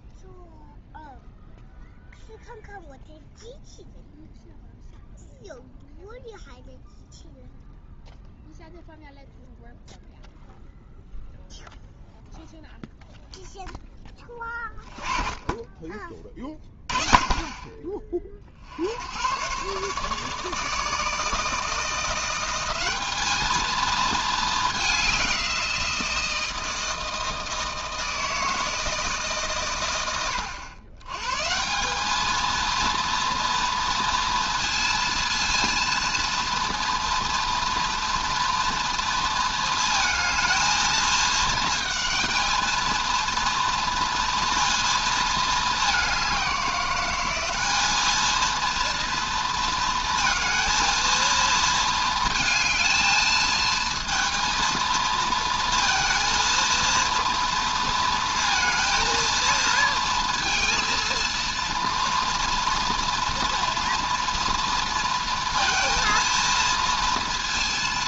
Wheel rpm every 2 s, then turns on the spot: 0, 0, 0, 0, 0, 0, 0, 10, 30, 50, 150, 190, 210, 160, 160, 100, 230, 230, 230, 230, 220, 230, 230, 190, 230, 230, 220, 230, 230, 230, 230, 230, 230, 230.
none